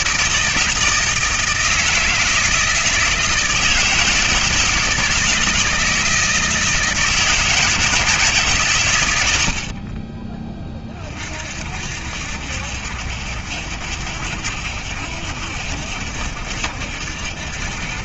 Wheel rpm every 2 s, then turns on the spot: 160, 160, 160, 160, 110, 40, 70, 60, 70.
none